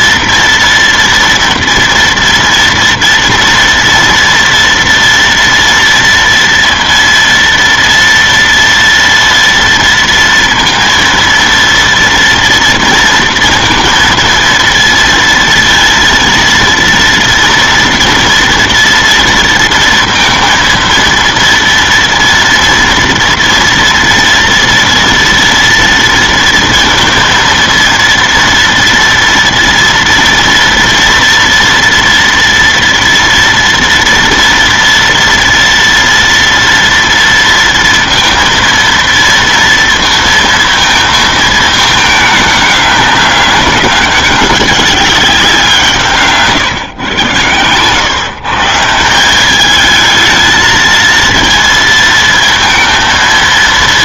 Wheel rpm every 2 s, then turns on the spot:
230, 230, 230, 230, 230, 230, 230, 230, 230, 230, 230, 230, 230, 230, 230, 230, 230, 230, 230, 230, 230, 210, 200, 140, 150, 220, 230.
none